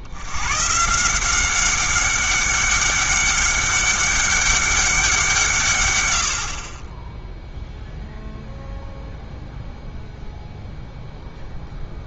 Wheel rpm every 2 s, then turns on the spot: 130, 200, 200, 40, 0, 0.
none